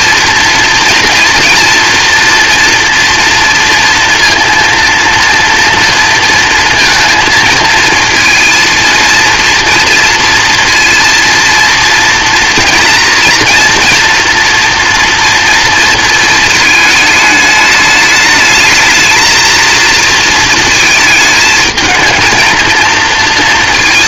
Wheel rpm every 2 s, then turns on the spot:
230, 230, 230, 230, 230, 230, 230, 230, 220, 220, 220, 230.
none